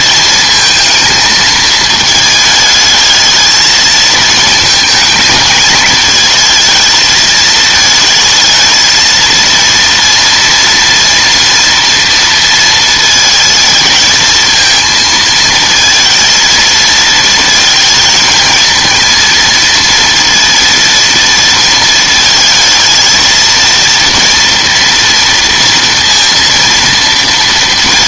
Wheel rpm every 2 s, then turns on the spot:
220, 220, 220, 220, 230, 240, 230, 230, 230, 230, 230, 220, 230, 230.
none